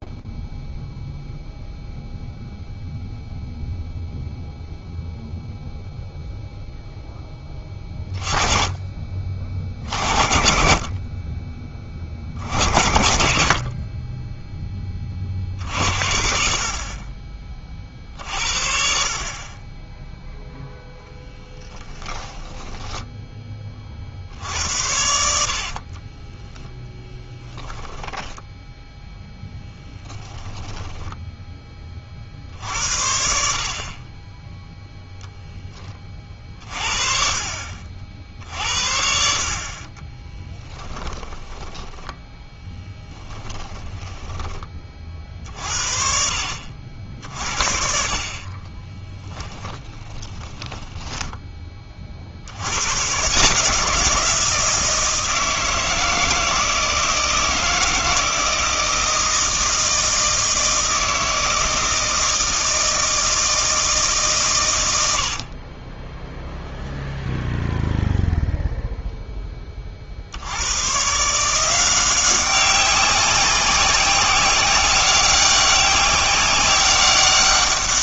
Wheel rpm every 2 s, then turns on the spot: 0, 0, 0, 0, 20, 50, 70, 10, 50, 50, 0, 10, 70, 10, 0, 10, 60, 0, 40, 60, 10, 10, 30, 60, 30, 20, 100, 170, 160, 160, 160, 160, 100, 0, 0, 90, 190, 190, 190.
22-24 26-28 40-44 48-52